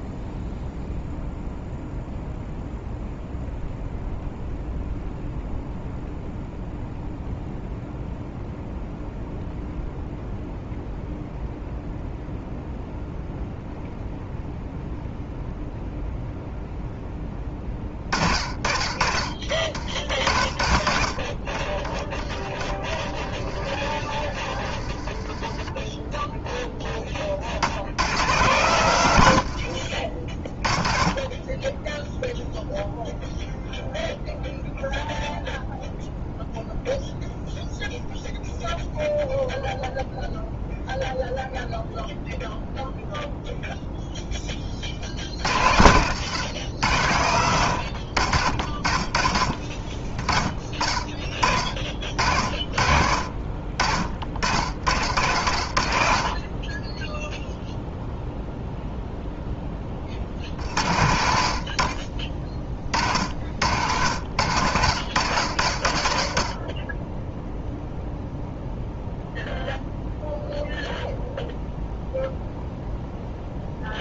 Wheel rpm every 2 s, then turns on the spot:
0, 0, 0, 0, 0, 0, 0, 0, 0, 50, 40, 20, 30, 10, 120, 30, 0, 0, 0, 0, 0, 0, 40, 100, 50, 20, 50, 60, 20, 0, 70, 30, 80, 40, 0, 0, 0.
none